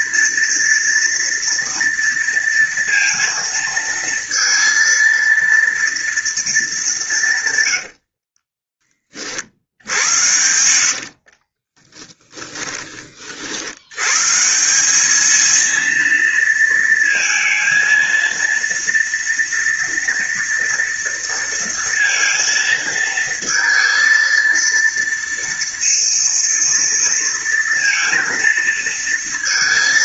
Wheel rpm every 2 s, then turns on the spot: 230, 230, 230, 210, 20, 80, 20, 180, 230, 230, 230, 230, 230, 230, 230.
10-12